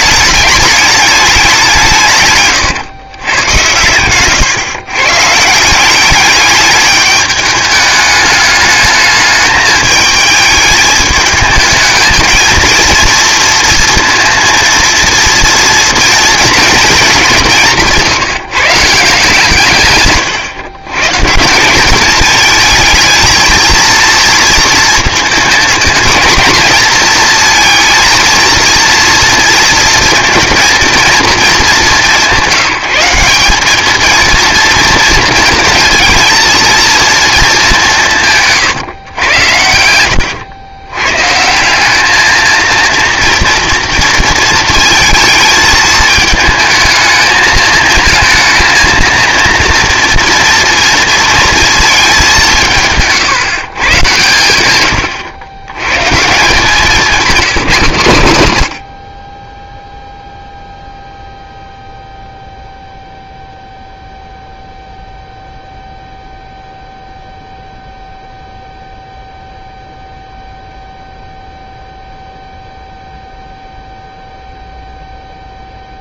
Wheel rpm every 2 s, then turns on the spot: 210, 130, 130, 210, 210, 220, 230, 230, 230, 150, 130, 220, 230, 230, 230, 230, 180, 230, 230, 150, 110, 230, 230, 220, 230, 230, 160, 100, 180, 90, 0, 0, 0, 0, 0, 0, 0, 0.
none